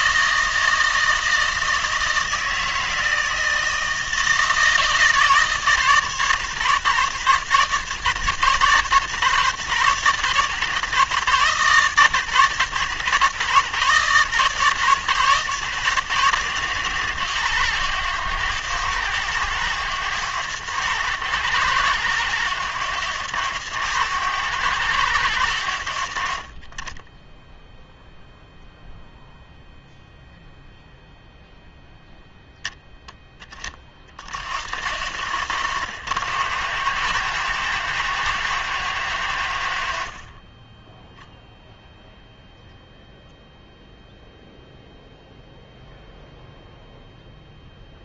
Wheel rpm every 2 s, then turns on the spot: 160, 160, 170, 160, 150, 170, 160, 160, 160, 160, 150, 160, 140, 90, 0, 0, 10, 120, 150, 160, 40, 0, 0, 0.
none